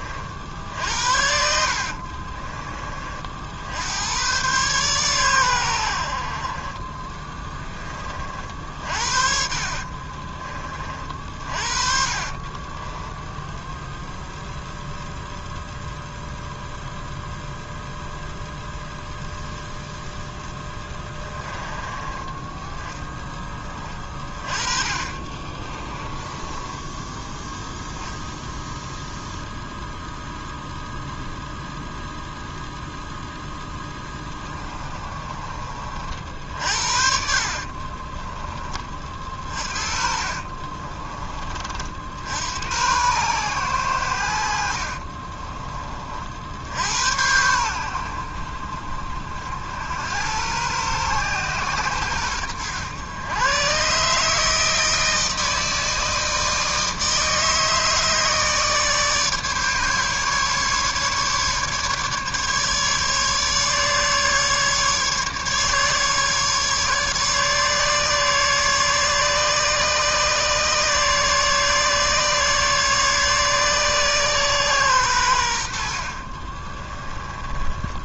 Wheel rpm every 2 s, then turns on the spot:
60, 40, 120, 40, 50, 40, 30, 0, 0, 0, 10, 10, 20, 10, 0, 0, 0, 20, 60, 20, 40, 80, 70, 60, 60, 110, 100, 160, 160, 150, 150, 150, 150, 150, 140, 150, 150, 130, 30.
8-10 12-14 24-28 34-36 40-42 76-78